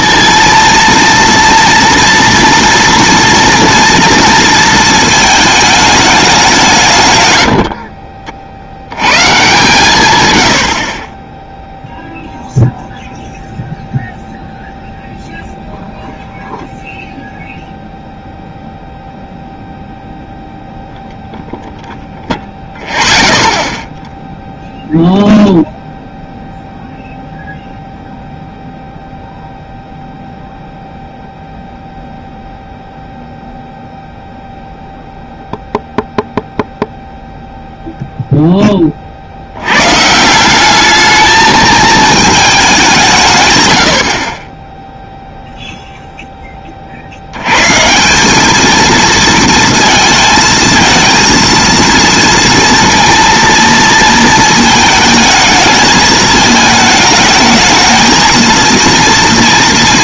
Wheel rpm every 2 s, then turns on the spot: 230, 230, 220, 140, 90, 60, 0, 0, 0, 0, 0, 0, 0, 0, 0, 0, 0, 0, 0, 10, 190, 200, 20, 20, 210, 220, 230, 220, 220, 230.
none